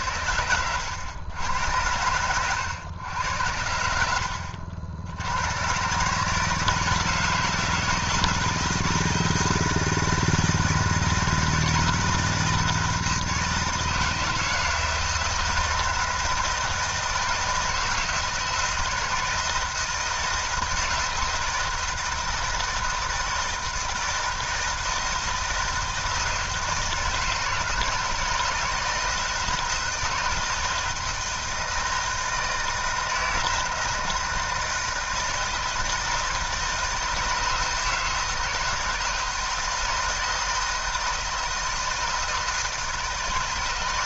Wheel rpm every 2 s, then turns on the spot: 90, 100, 80, 150, 160, 160, 160, 160, 160, 160, 160, 160, 160, 160, 160, 160, 160, 160, 160, 160, 160, 160.
none